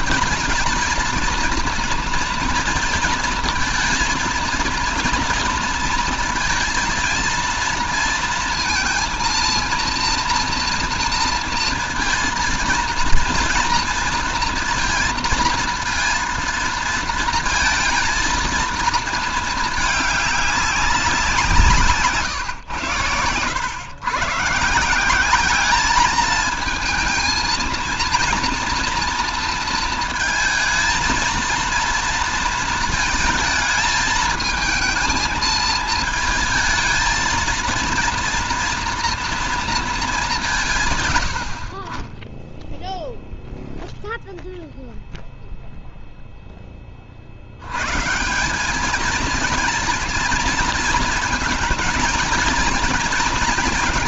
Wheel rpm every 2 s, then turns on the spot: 230, 230, 230, 230, 230, 230, 230, 230, 230, 230, 200, 120, 150, 220, 230, 230, 230, 220, 220, 230, 160, 10, 0, 20, 190, 230, 220.
none